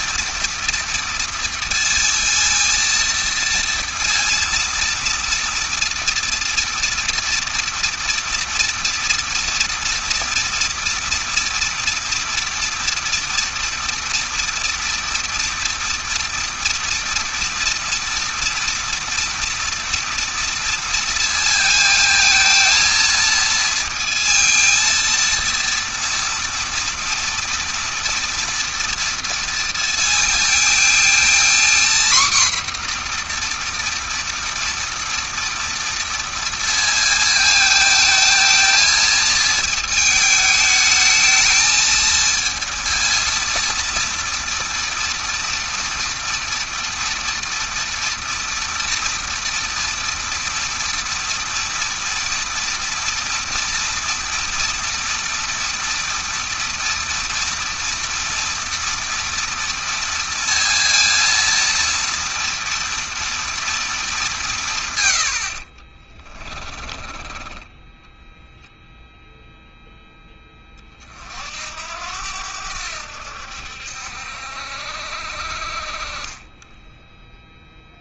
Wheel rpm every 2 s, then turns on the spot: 230, 230, 230, 230, 230, 230, 230, 230, 230, 230, 230, 230, 230, 230, 230, 220, 250, 230, 230, 220, 220, 230, 230, 230, 230, 230, 230, 230, 230, 230, 230, 230, 170, 30, 0, 40, 80, 60, 20.
66-68 76-78